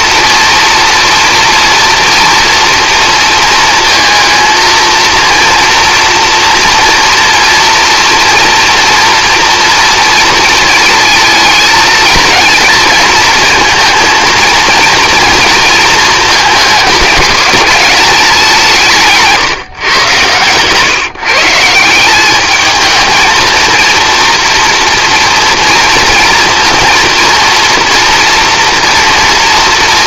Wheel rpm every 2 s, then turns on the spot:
230, 230, 230, 240, 230, 230, 230, 230, 220, 170, 130, 210, 230, 230, 240.
none